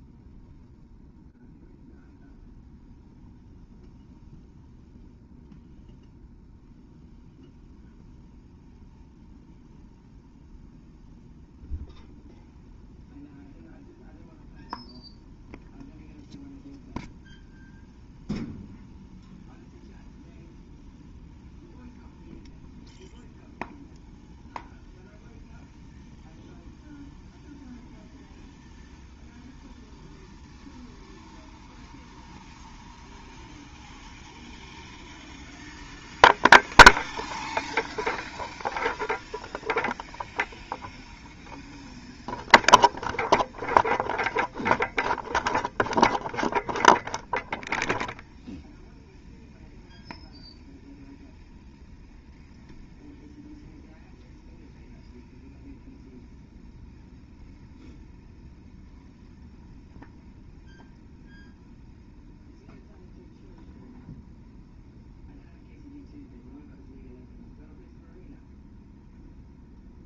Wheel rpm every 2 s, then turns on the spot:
0, 0, 0, 0, 0, 0, 0, 0, 0, 0, 0, 0, 0, 0, 0, 0, 0, 0, 0, 0, 0, 0, 0, 0, 0, 0, 0, 0, 0, 0, 0, 0, 0, 0, 0.
none